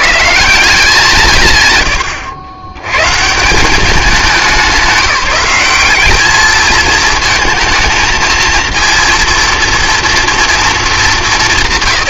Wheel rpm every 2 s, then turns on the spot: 170, 110, 190, 220, 230, 220.
none